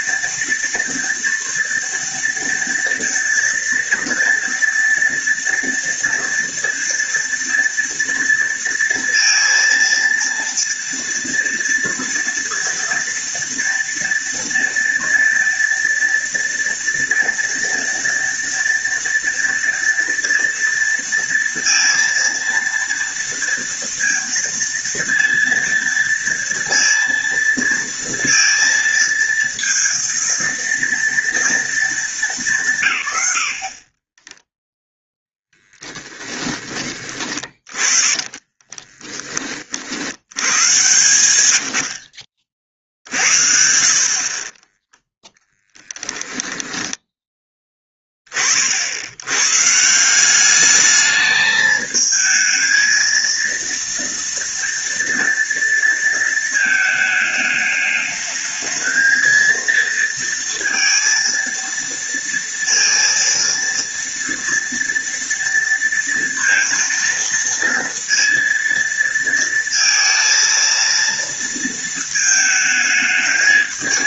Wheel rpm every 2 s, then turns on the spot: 230, 230, 240, 230, 230, 230, 230, 230, 230, 230, 230, 230, 230, 230, 230, 230, 160, 0, 20, 30, 110, 50, 20, 10, 40, 200, 220, 230, 220, 220, 230, 230, 230, 230, 230, 230, 220.
38-40 44-48